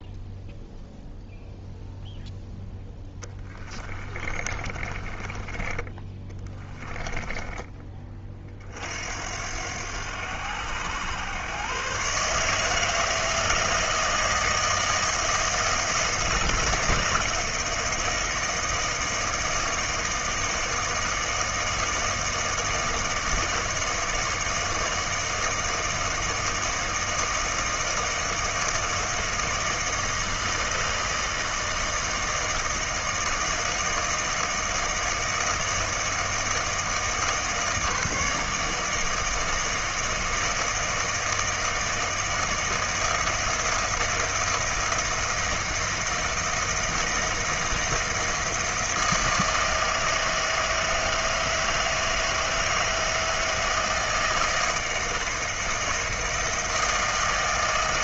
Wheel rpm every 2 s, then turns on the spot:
0, 0, 30, 20, 40, 90, 150, 160, 160, 160, 160, 160, 160, 160, 160, 160, 160, 160, 160, 160, 160, 160, 170, 170, 170, 160, 160, 160, 160.
4-8